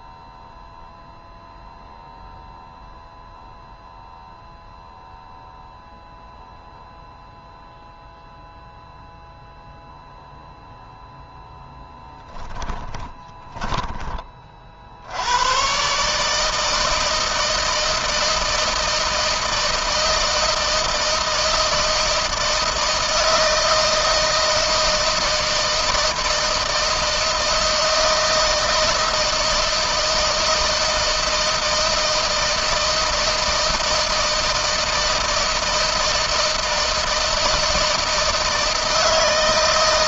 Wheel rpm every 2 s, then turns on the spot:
0, 0, 0, 0, 0, 0, 20, 80, 160, 160, 160, 160, 160, 160, 160, 160, 160, 160, 160, 160.
12-14